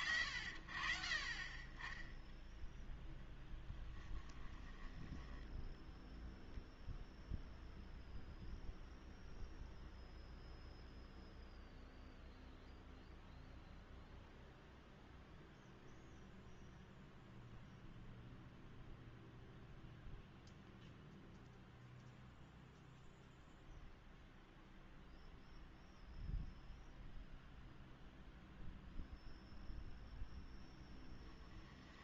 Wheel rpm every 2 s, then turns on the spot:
60, 10, 10, 0, 0, 0, 0, 0, 0, 0, 0, 0, 0, 0, 0, 10.
4-6 30-32